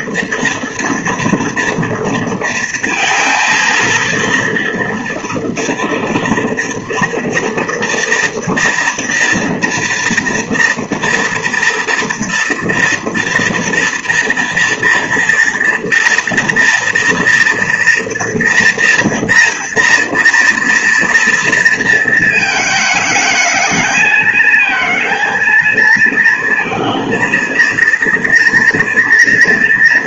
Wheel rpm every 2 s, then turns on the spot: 230, 230, 230, 230, 230, 230, 230, 230, 230, 230, 240, 220, 220, 230, 230.
none